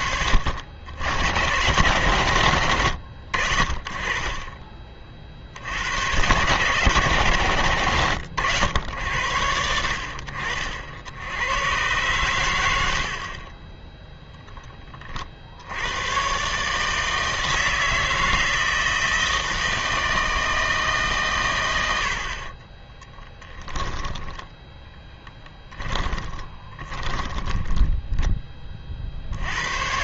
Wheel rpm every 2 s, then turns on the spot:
80, 90, 30, 110, 80, 60, 90, 10, 140, 160, 160, 30, 10, 30, 20.
22-28